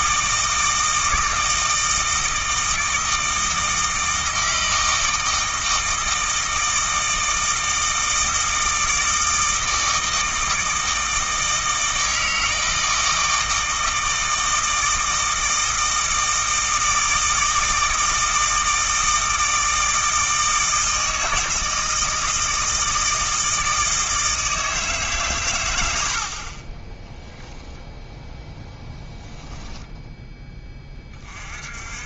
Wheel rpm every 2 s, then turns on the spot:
160, 160, 160, 160, 160, 160, 160, 160, 160, 160, 160, 160, 150, 20, 10, 20.
none